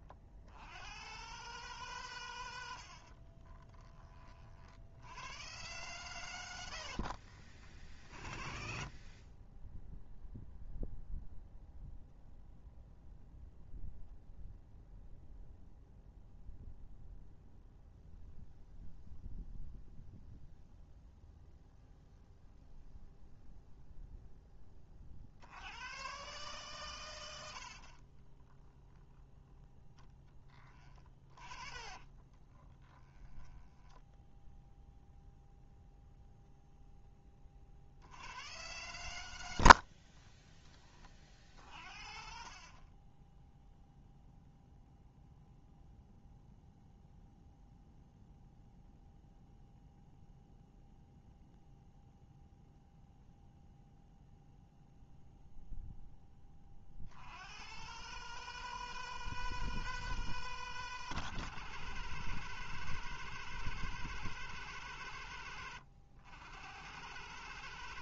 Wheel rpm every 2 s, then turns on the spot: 100, 70, 80, 60, 40, 0, 0, 0, 0, 0, 0, 0, 40, 110, 10, 20, 20, 0, 10, 110, 30, 30, 0, 0, 0, 0, 0, 0, 60, 160, 160, 160, 140, 130.
2-4 6-8 30-34 42-44